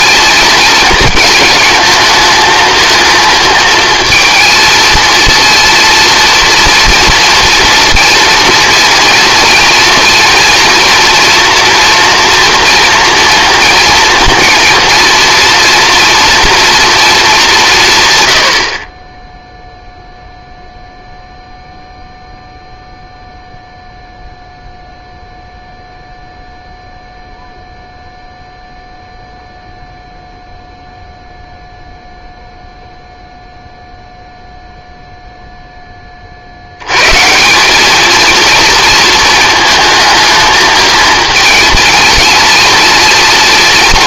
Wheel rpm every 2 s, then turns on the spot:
220, 230, 230, 230, 230, 240, 230, 230, 230, 50, 0, 0, 0, 0, 0, 0, 0, 0, 100, 230, 220, 230.
none